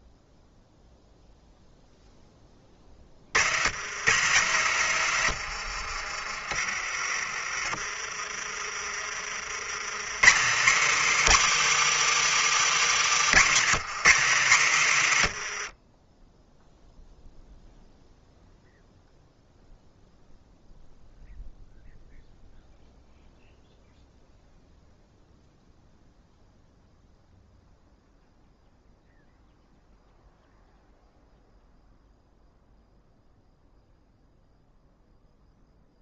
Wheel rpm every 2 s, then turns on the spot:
0, 40, 140, 70, 60, 250, 290, 210, 10, 0, 0, 0, 0, 0, 0, 0, 0, 0.
8-10 12-14 16-18